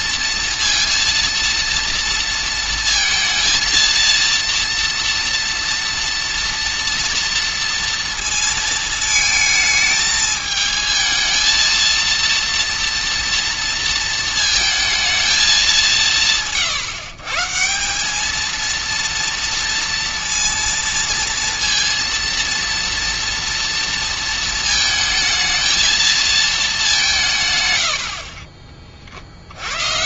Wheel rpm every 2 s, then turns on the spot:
230, 230, 230, 230, 230, 220, 230, 220, 150, 230, 230, 230, 220, 210, 20.
none